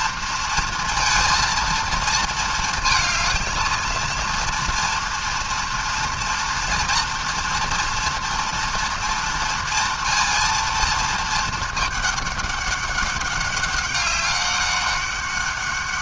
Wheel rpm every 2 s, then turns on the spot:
230, 230, 230, 230, 230, 230, 200, 200.
none